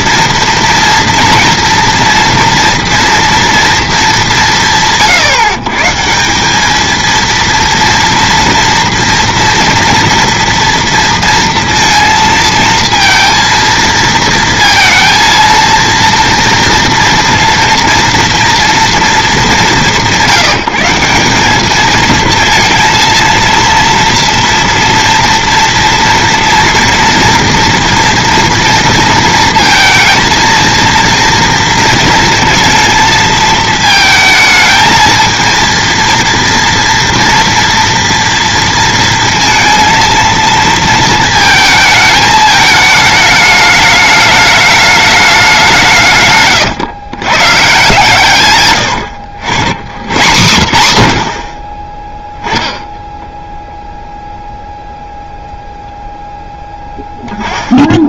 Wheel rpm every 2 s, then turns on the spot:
230, 230, 170, 190, 230, 230, 220, 230, 230, 230, 180, 230, 230, 230, 230, 230, 230, 220, 230, 230, 230, 210, 210, 130, 120, 110, 10, 0, 0.
46-48